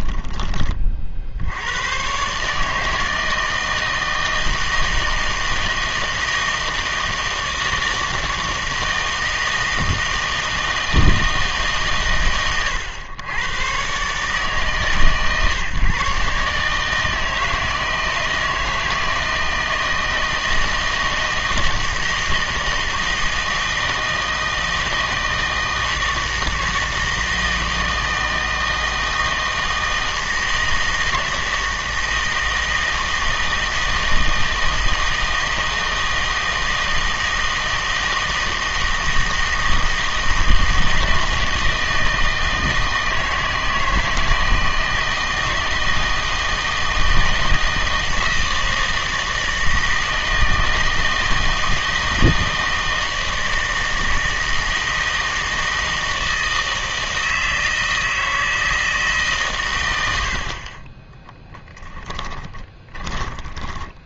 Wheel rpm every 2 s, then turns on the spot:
30, 150, 160, 160, 160, 160, 100, 140, 150, 160, 160, 160, 160, 160, 160, 160, 160, 160, 160, 160, 160, 160, 160, 160, 160, 160, 160, 160, 160, 160, 40, 20.
62-64